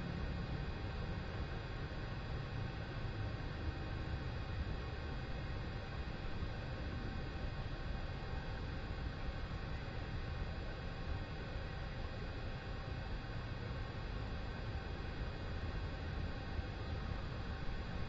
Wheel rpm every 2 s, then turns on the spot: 0, 0, 0, 0, 0, 0, 0, 0, 0.
none